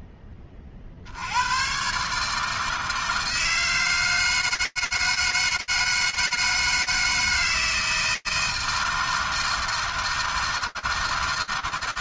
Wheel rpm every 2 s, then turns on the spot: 30, 160, 160, 160, 160, 160.
none